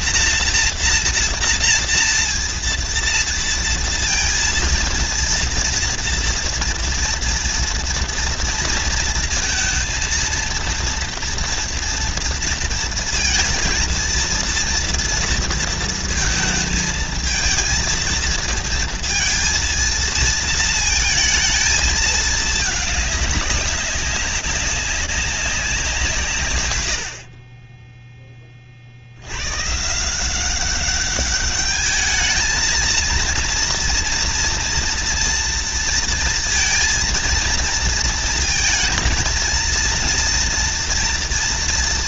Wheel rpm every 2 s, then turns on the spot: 230, 230, 230, 240, 230, 230, 230, 230, 230, 230, 230, 210, 200, 110, 40, 190, 220, 230, 230, 230, 230.
none